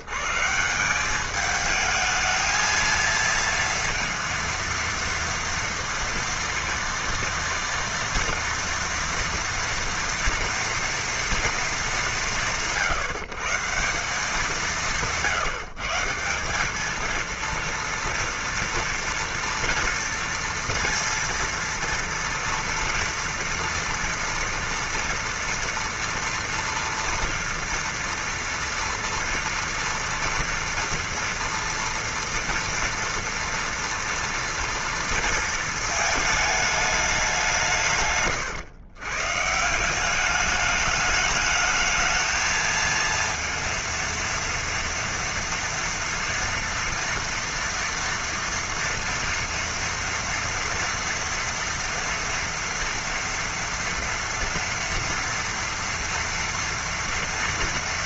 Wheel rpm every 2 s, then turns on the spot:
120, 220, 230, 230, 230, 230, 180, 190, 180, 230, 230, 230, 230, 230, 230, 230, 240, 230, 220, 130, 200, 220, 230, 230, 230, 230, 230, 230, 230.
38-40